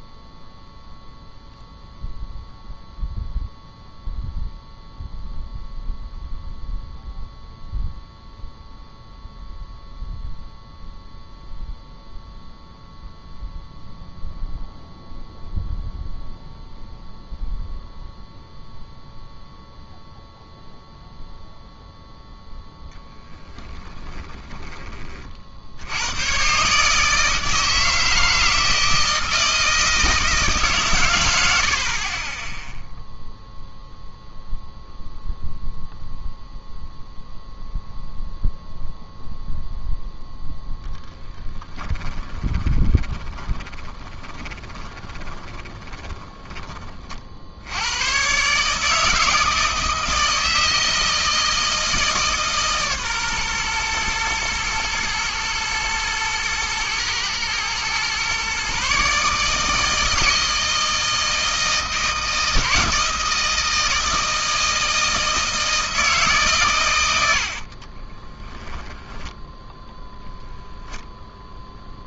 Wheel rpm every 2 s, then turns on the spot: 0, 0, 0, 0, 0, 0, 0, 0, 0, 0, 0, 10, 30, 150, 160, 130, 0, 0, 0, 0, 0, 20, 20, 50, 150, 160, 140, 110, 110, 140, 160, 160, 160, 110, 10, 0.
42-46 68-70